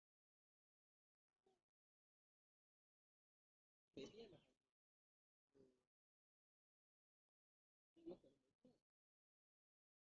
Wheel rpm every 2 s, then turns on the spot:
0, 0, 0, 0, 0.
none